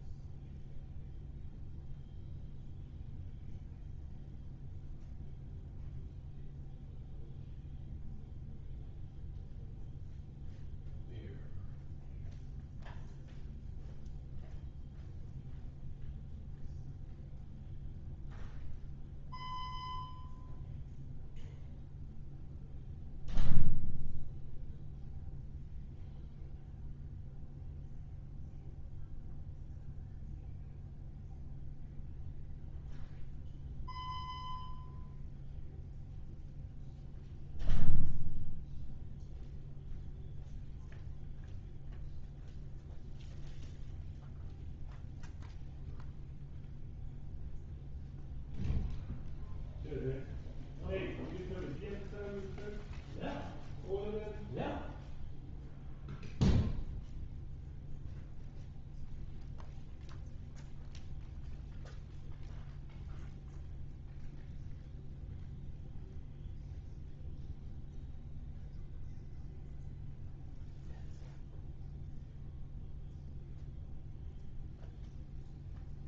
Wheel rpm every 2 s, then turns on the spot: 0, 0, 0, 0, 0, 0, 0, 0, 0, 0, 0, 0, 0, 0, 0, 0, 0, 0, 0, 0, 0, 0, 0, 0, 0, 0, 0, 0, 0, 0, 0, 0, 0, 0, 0, 0, 0, 0.
none